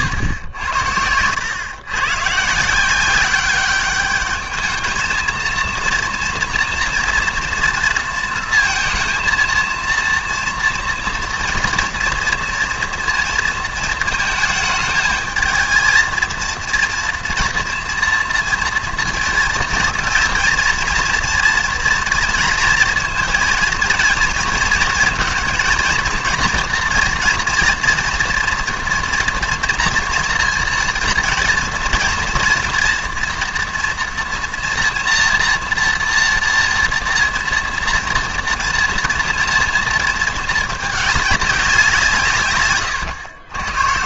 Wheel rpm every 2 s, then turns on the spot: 90, 170, 220, 230, 230, 240, 230, 220, 230, 240, 230, 230, 230, 240, 230, 230, 230, 230, 230, 230, 220, 130.
0-2